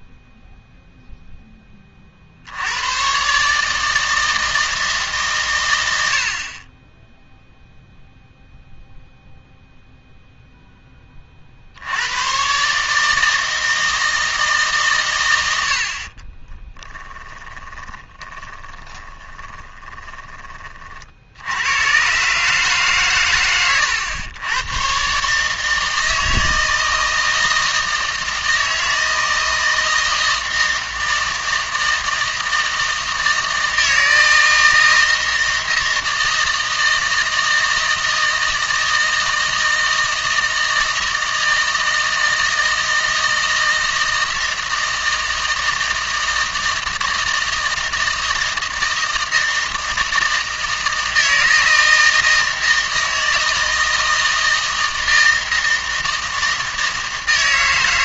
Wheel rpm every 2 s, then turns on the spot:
0, 110, 160, 30, 0, 10, 140, 150, 10, 20, 40, 140, 120, 160, 160, 160, 160, 160, 160, 160, 160, 160, 160, 160, 160, 160, 160, 160, 160.
16-20